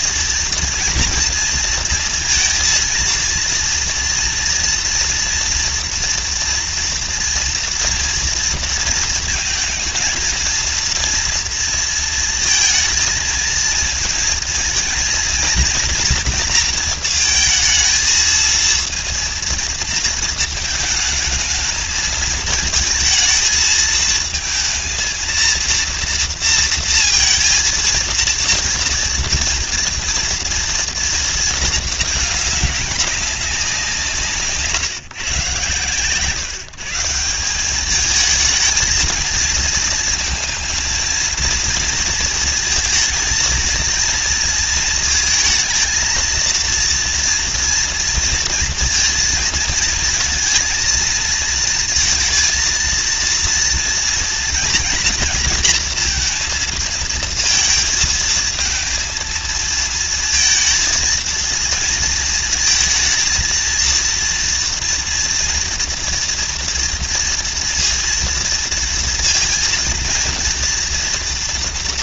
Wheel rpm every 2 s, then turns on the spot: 230, 230, 240, 230, 230, 230, 230, 230, 230, 230, 220, 230, 230, 230, 230, 230, 200, 160, 150, 220, 230, 230, 230, 230, 230, 230, 230, 240, 220, 220, 230, 220, 230, 230, 230, 230.
none